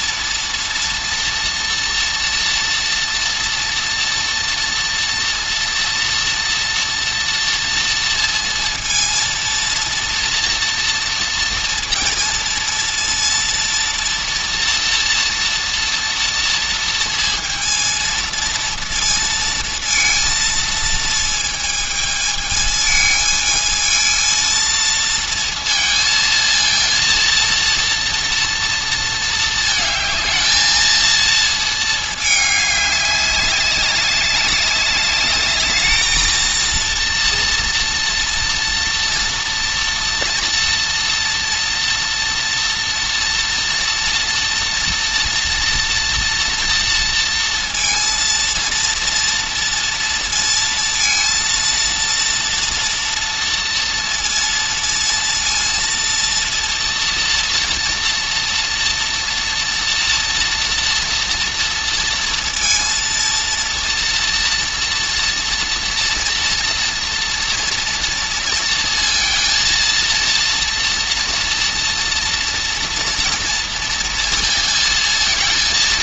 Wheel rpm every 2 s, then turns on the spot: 230, 240, 230, 230, 230, 240, 230, 230, 230, 230, 220, 220, 230, 230, 230, 220, 200, 200, 230, 230, 230, 240, 230, 230, 230, 230, 230, 230, 230, 230, 230, 230, 240, 230, 230, 230, 230, 230.
none